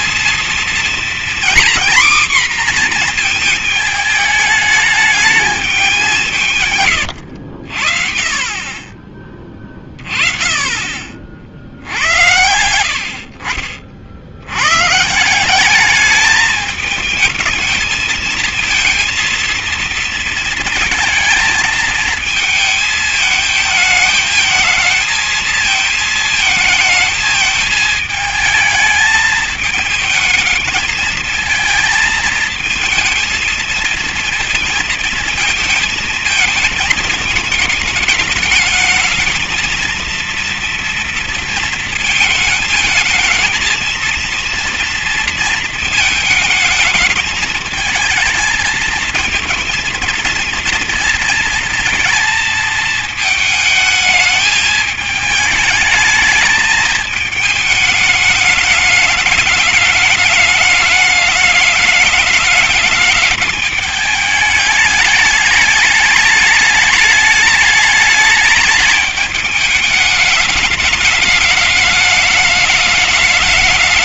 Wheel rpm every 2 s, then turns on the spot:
230, 250, 210, 160, 30, 20, 70, 90, 220, 230, 230, 220, 220, 220, 220, 220, 220, 220, 230, 210, 230, 220, 230, 220, 220, 230, 230, 220, 220, 210, 210, 210, 210, 210, 210, 210, 210.
none